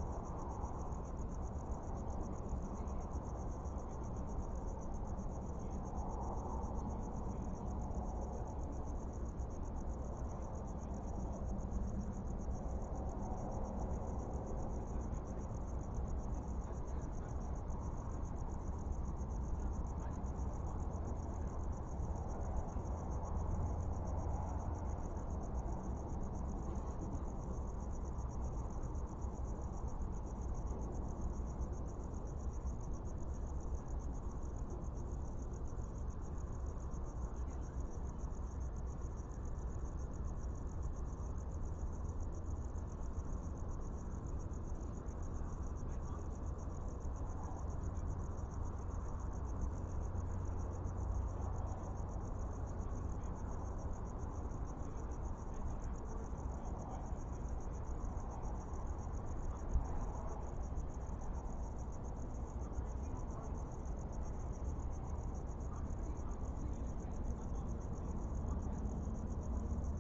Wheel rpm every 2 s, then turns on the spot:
0, 0, 0, 0, 0, 0, 0, 0, 0, 0, 0, 0, 0, 0, 0, 0, 0, 0, 0, 0, 0, 0, 0, 0, 0, 0, 0, 0, 0, 0, 0, 0, 0, 0, 0.
none